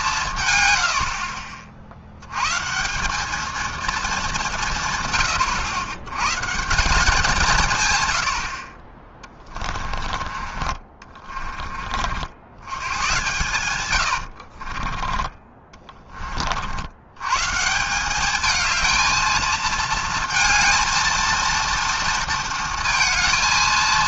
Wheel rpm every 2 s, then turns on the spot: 130, 130, 170, 160, 60, 30, 80, 70, 60, 210, 220, 230.
14-16